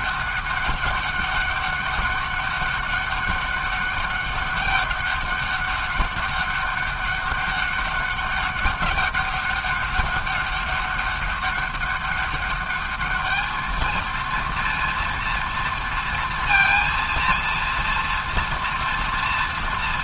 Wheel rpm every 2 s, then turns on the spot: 200, 200, 200, 200, 200, 200, 200, 230, 230, 230.
none